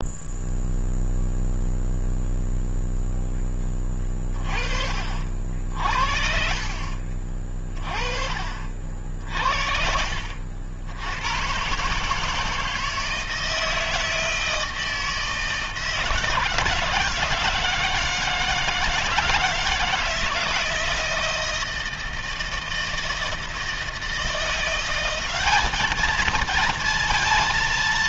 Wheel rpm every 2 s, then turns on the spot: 0, 0, 30, 40, 50, 70, 160, 160, 160, 160, 160, 170, 180, 230.
6-8